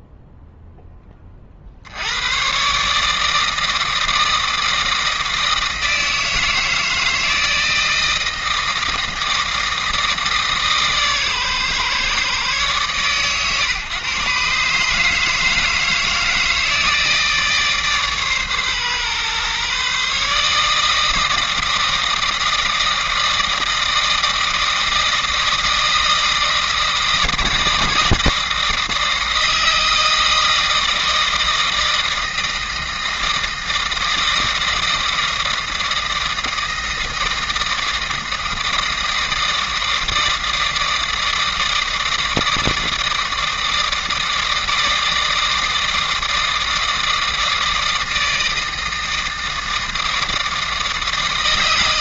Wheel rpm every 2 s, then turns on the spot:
10, 140, 160, 160, 160, 150, 120, 150, 160, 130, 150, 160, 160, 160, 160, 160, 160, 160, 160, 160, 160, 160, 160, 160, 160, 160.
none